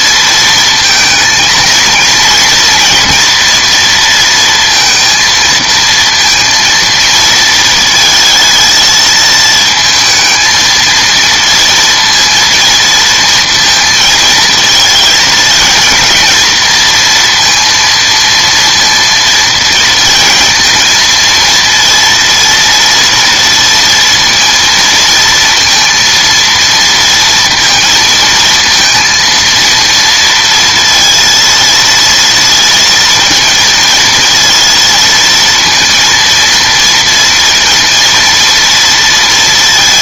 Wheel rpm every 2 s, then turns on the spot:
230, 230, 230, 230, 230, 220, 230, 220, 230, 230, 230, 230, 230, 230, 230, 230, 230, 230, 230, 230.
none